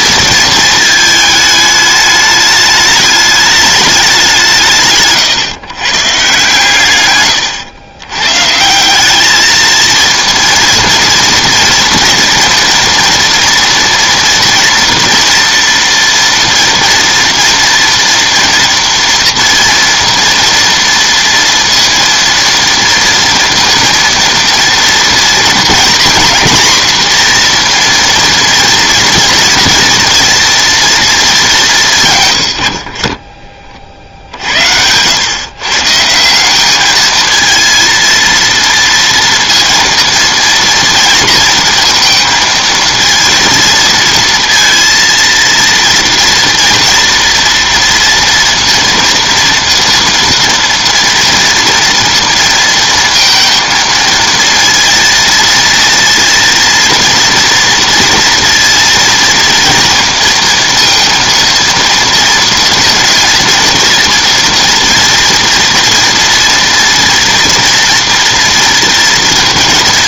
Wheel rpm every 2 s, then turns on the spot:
220, 210, 160, 130, 170, 230, 230, 230, 230, 240, 230, 230, 230, 240, 230, 230, 60, 80, 200, 230, 230, 230, 230, 230, 230, 230, 230, 230, 230, 230, 230, 230, 230, 240, 240.
32-34